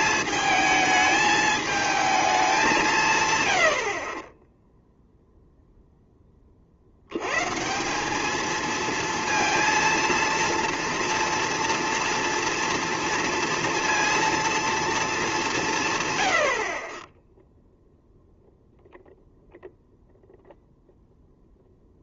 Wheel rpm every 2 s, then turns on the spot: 220, 200, 10, 60, 220, 230, 230, 230, 60, 0, 0.
none